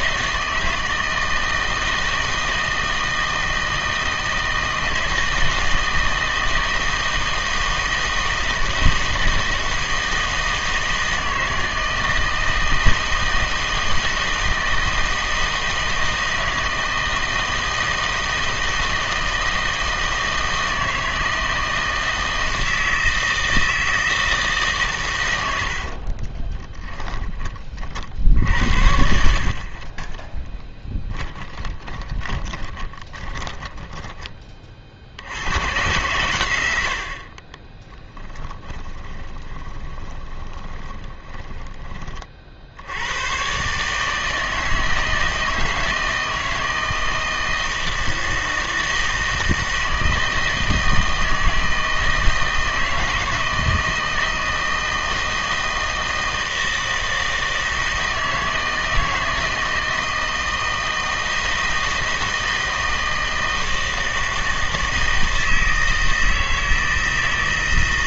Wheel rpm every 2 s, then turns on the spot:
160, 160, 160, 160, 160, 160, 160, 160, 160, 160, 160, 160, 140, 20, 80, 20, 20, 40, 90, 10, 20, 70, 160, 160, 160, 160, 160, 160, 160, 160, 160, 160, 160, 160.
26-28 30-34 38-42